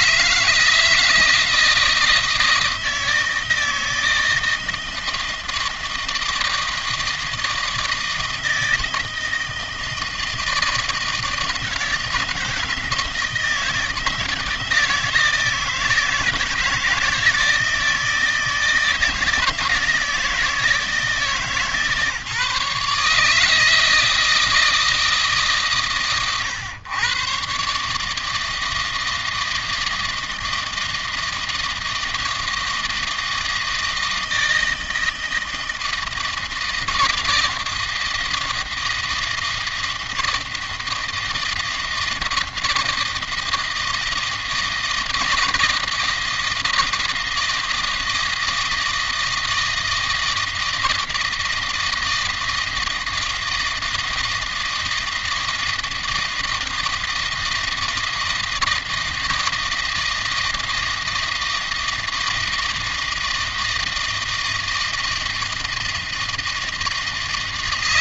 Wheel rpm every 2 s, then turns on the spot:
160, 160, 160, 160, 160, 160, 160, 160, 160, 160, 160, 150, 160, 120, 160, 160, 160, 160, 160, 160, 160, 160, 160, 160, 160, 160, 160, 160, 160, 160, 160, 160, 160, 160.
none